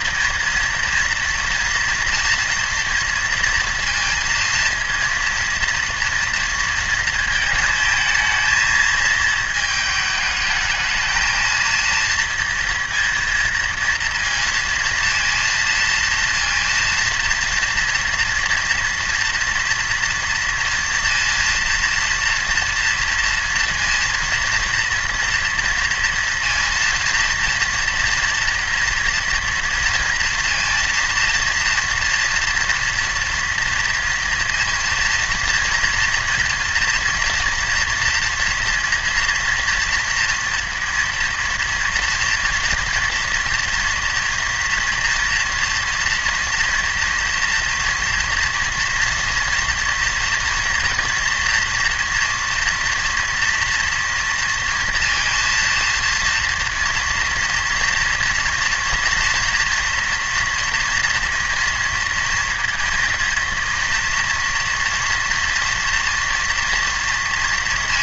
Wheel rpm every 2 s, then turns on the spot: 230, 230, 230, 230, 220, 220, 230, 230, 230, 230, 230, 230, 230, 230, 230, 230, 240, 230, 230, 230, 230, 230, 240, 230, 240, 230, 230, 230, 230, 230, 230, 230, 230, 230.
none